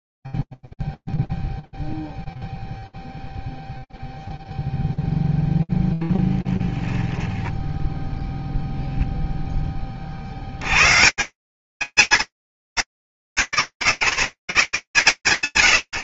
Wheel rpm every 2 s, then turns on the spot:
0, 0, 0, 10, 0, 70, 170, 130.
6-8